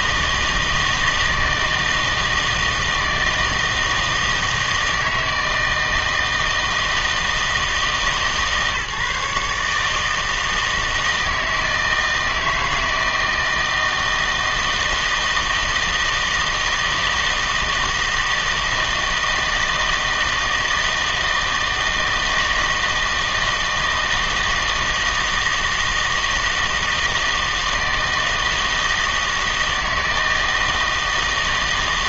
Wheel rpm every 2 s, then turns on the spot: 160, 160, 160, 160, 140, 160, 160, 160, 160, 160, 160, 160, 160, 160, 160, 160.
none